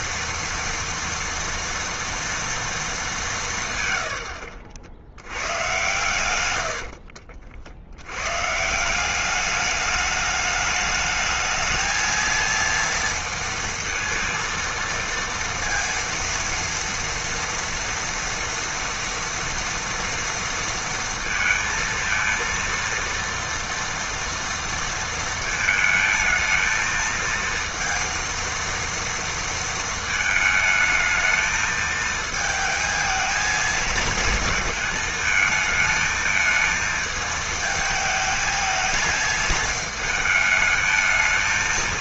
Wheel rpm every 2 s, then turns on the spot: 230, 230, 60, 100, 150, 210, 230, 230, 230, 230, 230, 230, 230, 220, 230, 220, 220, 230, 220, 220, 220.
6-8